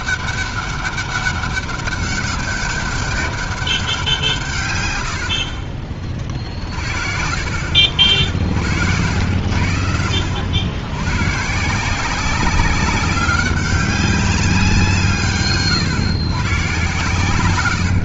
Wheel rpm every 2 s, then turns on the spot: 200, 200, 140, 70, 70, 90, 190, 180, 120.
none